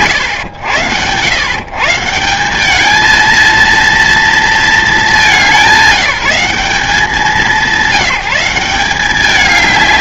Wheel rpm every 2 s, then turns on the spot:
110, 200, 220, 180, 190.
none